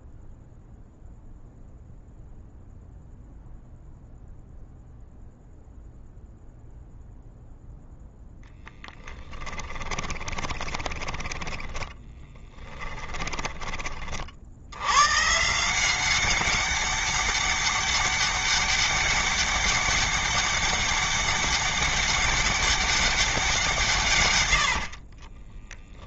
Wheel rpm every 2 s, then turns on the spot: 0, 0, 0, 0, 10, 10, 10, 120, 200, 200, 200, 190, 50.
8-14 24-26